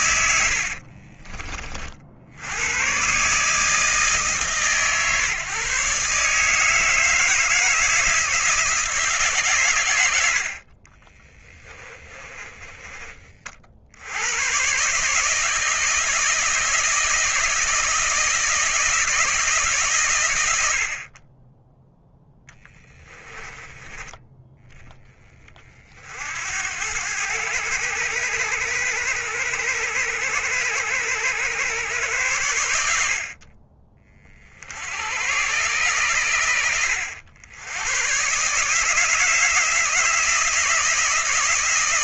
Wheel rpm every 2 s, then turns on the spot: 60, 100, 140, 160, 160, 40, 20, 130, 160, 160, 70, 10, 20, 90, 100, 100, 80, 70, 90, 160, 170.
0-2 10-14